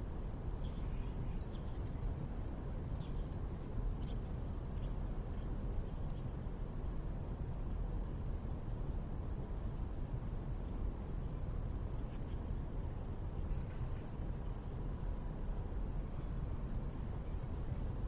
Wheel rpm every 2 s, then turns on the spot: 0, 0, 0, 0, 0, 0, 0, 0, 0.
none